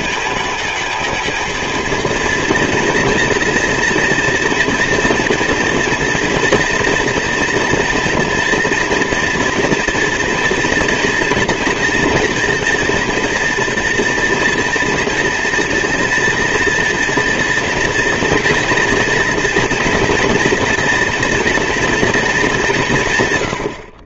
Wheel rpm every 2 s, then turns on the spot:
220, 230, 230, 230, 230, 230, 230, 230, 230, 230, 240, 170.
none